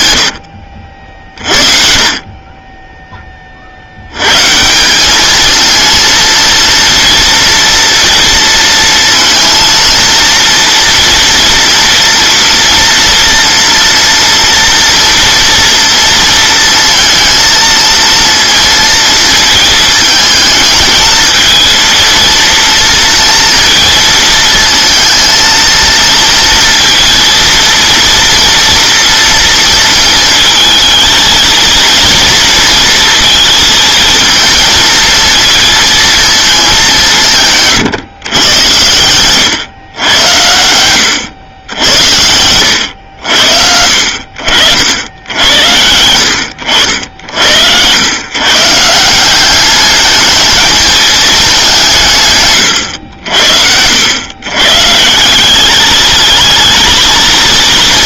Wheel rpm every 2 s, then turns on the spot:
70, 20, 160, 230, 230, 240, 230, 230, 230, 230, 220, 230, 230, 230, 230, 230, 230, 230, 210, 110, 100, 90, 70, 70, 150, 210, 120, 120, 220.
38-40